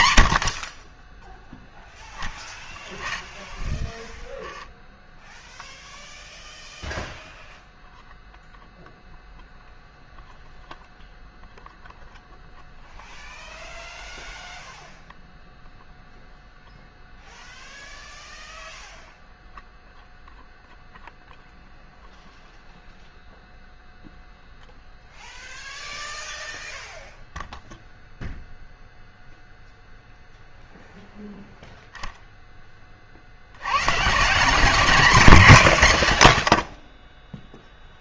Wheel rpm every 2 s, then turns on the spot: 20, 10, 10, 0, 0, 0, 0, 0, 0, 0, 0, 0, 0, 0, 0, 0, 20, 220, 20.
2-6